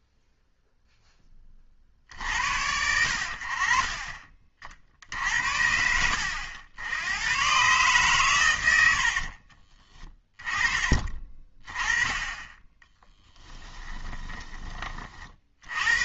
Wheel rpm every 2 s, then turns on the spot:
0, 70, 40, 90, 110, 20, 20, 20.
none